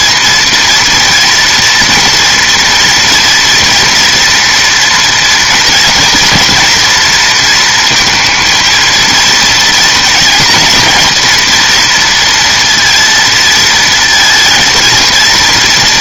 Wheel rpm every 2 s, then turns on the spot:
240, 230, 240, 230, 230, 230, 230, 230.
none